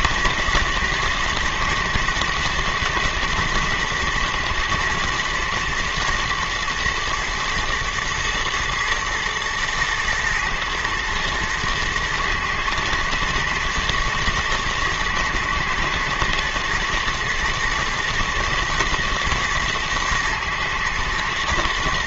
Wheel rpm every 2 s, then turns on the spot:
110, 120, 120, 120, 110, 110, 110, 120, 120, 110, 120.
none